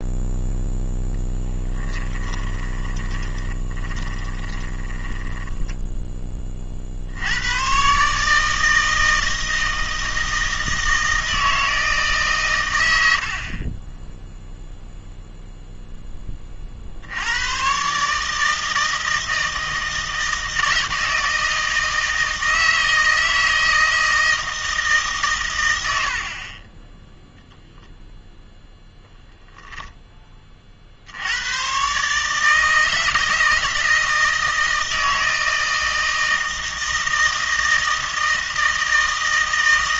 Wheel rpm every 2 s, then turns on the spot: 0, 20, 10, 40, 160, 160, 100, 0, 50, 160, 160, 160, 160, 20, 0, 40, 160, 160, 160, 160.
2-6